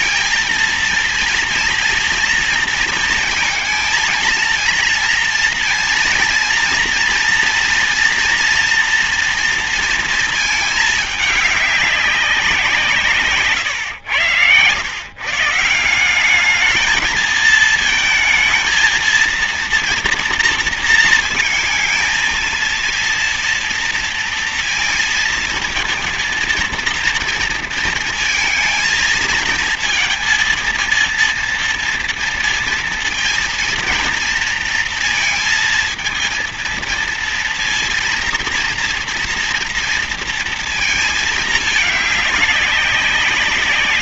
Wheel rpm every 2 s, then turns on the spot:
230, 230, 230, 230, 230, 220, 190, 120, 200, 220, 230, 230, 230, 230, 230, 230, 230, 230, 230, 230, 230, 200.
none